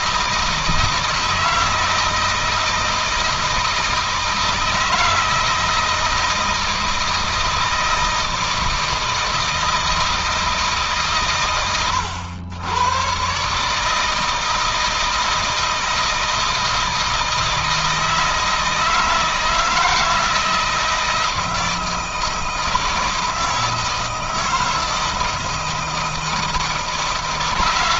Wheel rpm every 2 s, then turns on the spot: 160, 160, 160, 160, 160, 140, 110, 160, 160, 160, 160, 160, 160, 160.
none